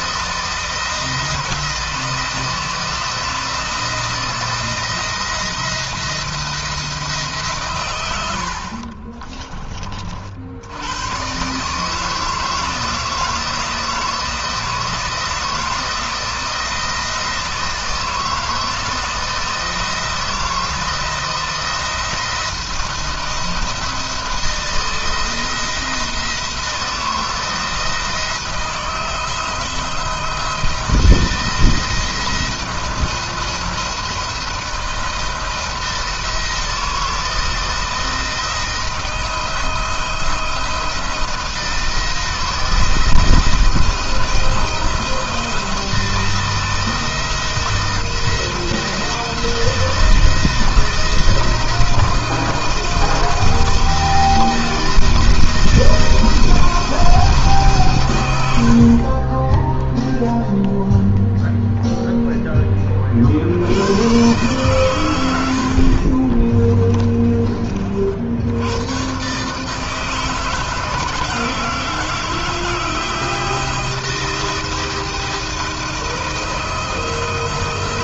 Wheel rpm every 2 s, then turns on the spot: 160, 160, 170, 160, 40, 100, 160, 160, 160, 160, 170, 170, 170, 160, 160, 160, 170, 170, 170, 160, 160, 160, 170, 170, 170, 160, 170, 170, 170, 50, 0, 30, 110, 20, 110, 160, 170, 170, 160.
8-10 66-68